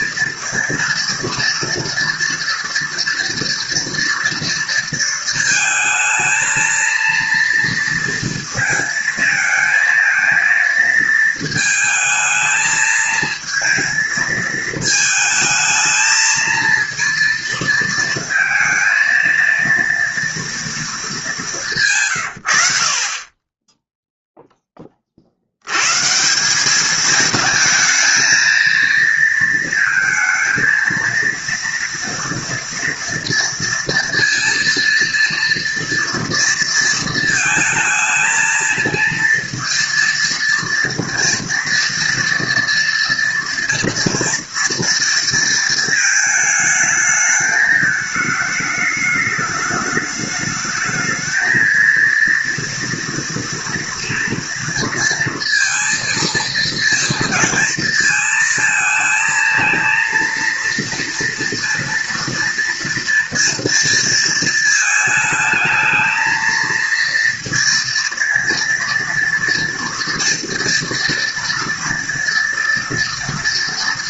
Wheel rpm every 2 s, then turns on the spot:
230, 230, 230, 230, 230, 220, 220, 220, 230, 230, 230, 90, 10, 180, 220, 230, 240, 230, 230, 220, 230, 230, 230, 220, 210, 210, 230, 230, 230, 220, 230, 230, 230, 230, 230, 230, 230.
none